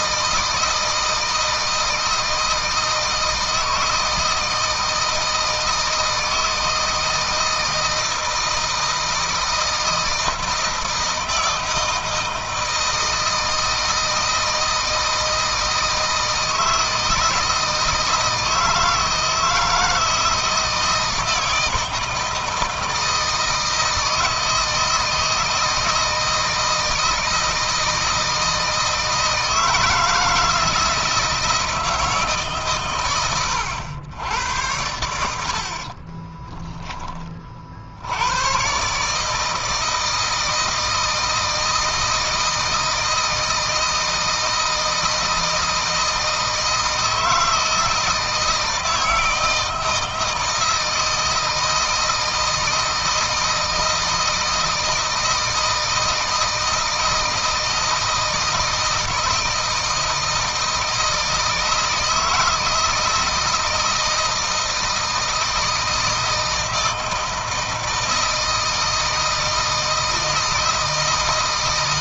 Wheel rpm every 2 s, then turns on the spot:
160, 160, 160, 160, 160, 160, 160, 160, 160, 160, 160, 160, 160, 160, 160, 160, 140, 80, 10, 120, 160, 160, 160, 160, 160, 160, 160, 160, 160, 160, 160, 160, 160, 160, 160, 160.
none